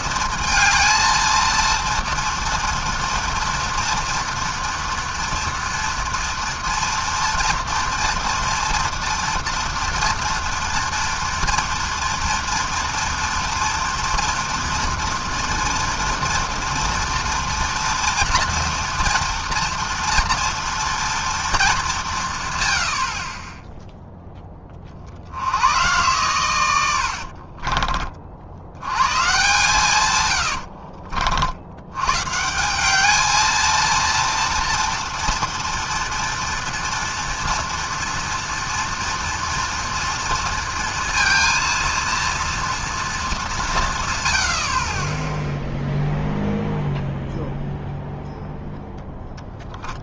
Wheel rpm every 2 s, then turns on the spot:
220, 230, 230, 230, 230, 230, 230, 230, 230, 240, 240, 130, 20, 100, 70, 90, 160, 230, 240, 230, 230, 230, 80, 0, 0.
30-32